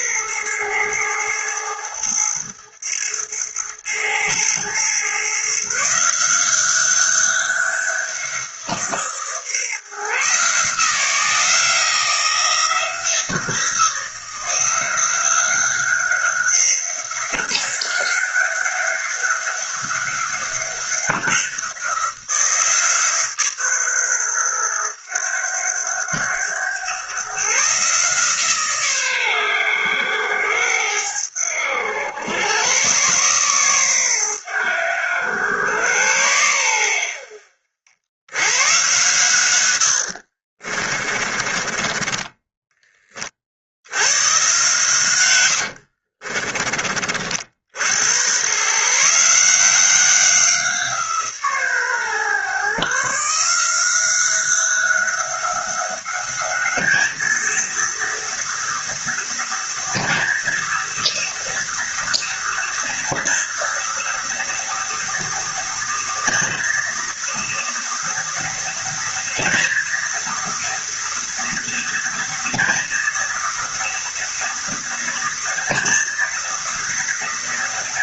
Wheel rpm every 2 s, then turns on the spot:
120, 110, 120, 180, 170, 160, 170, 180, 190, 200, 200, 170, 110, 100, 140, 90, 110, 100, 100, 120, 50, 20, 130, 40, 130, 180, 140, 190, 210, 230, 230, 230, 230, 240, 230, 230, 230, 230, 230.
40-42